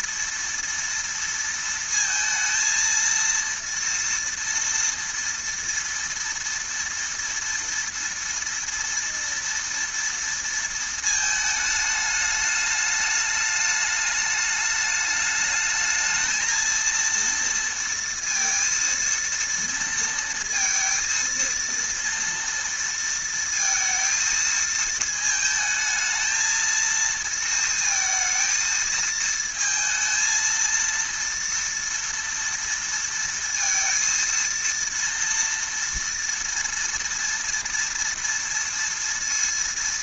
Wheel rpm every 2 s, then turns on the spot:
230, 230, 230, 230, 230, 230, 210, 210, 220, 230, 230, 230, 220, 230, 230, 230, 230, 230, 230, 230.
none